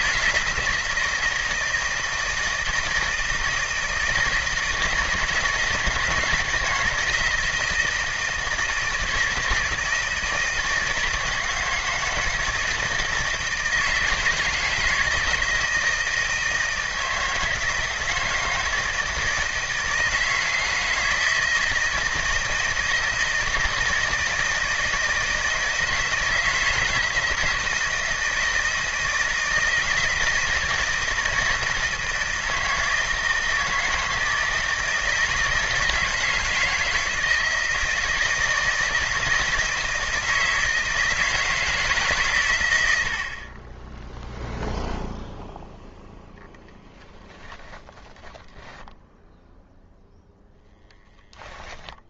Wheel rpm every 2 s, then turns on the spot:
170, 160, 160, 170, 160, 160, 160, 160, 160, 160, 160, 160, 160, 160, 160, 160, 160, 160, 160, 160, 160, 100, 0, 20, 20, 0.
46-50